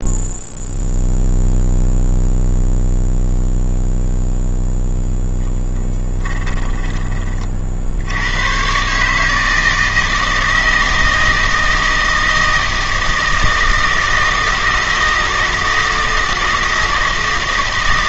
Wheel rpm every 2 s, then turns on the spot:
0, 0, 0, 20, 130, 160, 160, 160, 160.
6-8